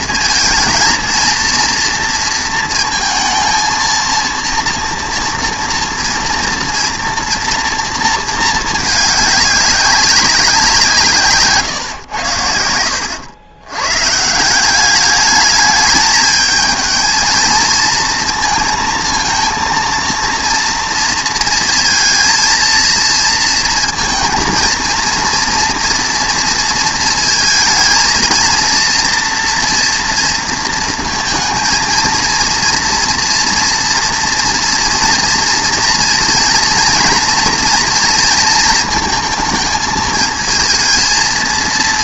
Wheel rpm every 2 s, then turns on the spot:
230, 230, 230, 230, 210, 160, 80, 200, 220, 230, 230, 230, 230, 230, 230, 230, 230, 230, 230, 230, 220.
12-14